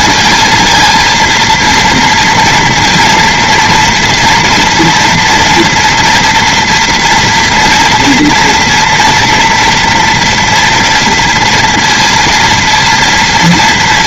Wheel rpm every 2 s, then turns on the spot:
230, 230, 230, 230, 230, 230, 230.
none